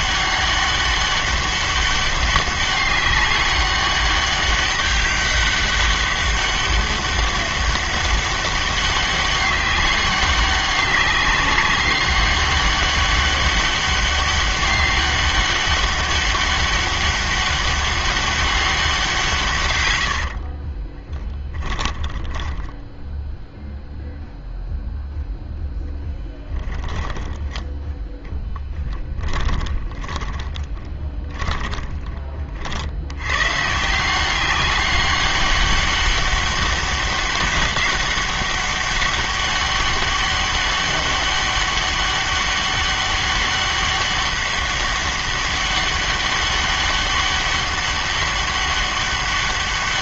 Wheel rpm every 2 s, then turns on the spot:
200, 200, 200, 200, 200, 200, 200, 200, 200, 190, 40, 10, 0, 10, 10, 10, 50, 200, 200, 200, 200, 200, 200, 200, 200.
20-24 26-32